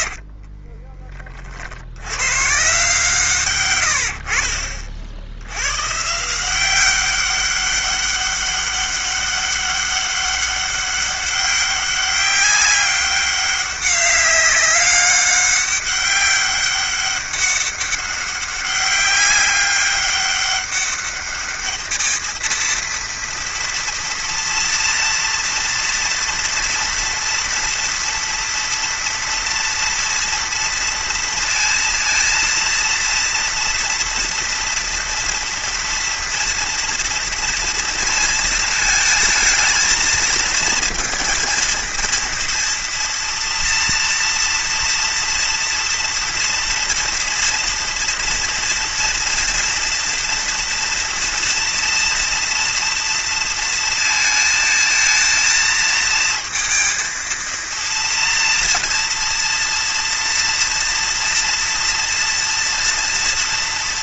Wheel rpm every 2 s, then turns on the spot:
30, 140, 50, 190, 200, 200, 200, 200, 200, 190, 200, 230, 230, 230, 230, 230, 230, 230, 230, 220, 230, 230, 230, 230, 230, 230, 230, 220, 230, 230, 230, 230.
0-2